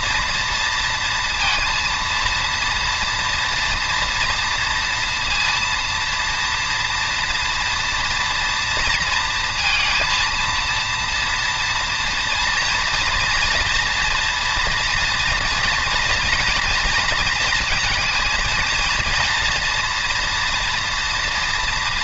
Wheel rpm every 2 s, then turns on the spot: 230, 230, 230, 240, 230, 230, 230, 230, 230, 220, 230.
none